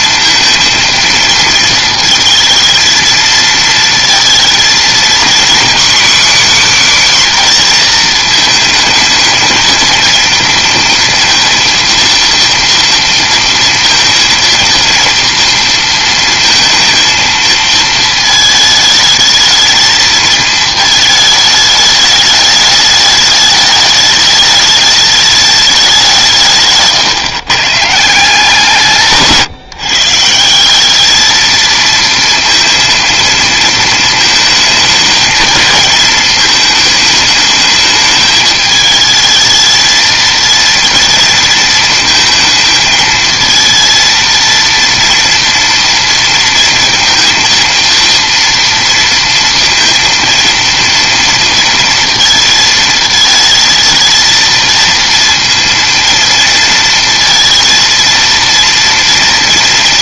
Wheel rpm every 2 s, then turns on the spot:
230, 230, 230, 270, 220, 230, 230, 230, 230, 220, 220, 210, 210, 160, 160, 180, 230, 220, 220, 210, 230, 220, 230, 230, 230, 230, 220, 230, 230, 230.
none